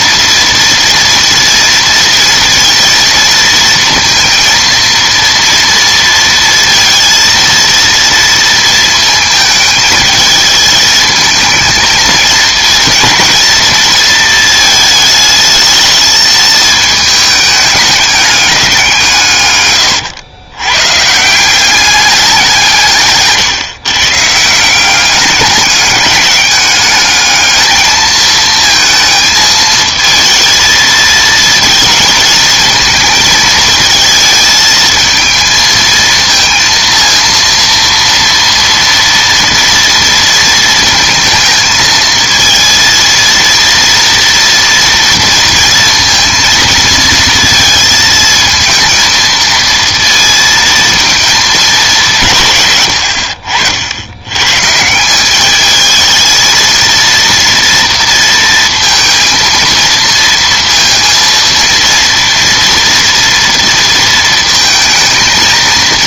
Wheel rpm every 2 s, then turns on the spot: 230, 230, 230, 230, 220, 220, 230, 220, 220, 170, 130, 160, 190, 210, 220, 220, 220, 220, 230, 230, 230, 230, 230, 230, 220, 220, 100, 170, 230, 230, 230, 240, 220.
none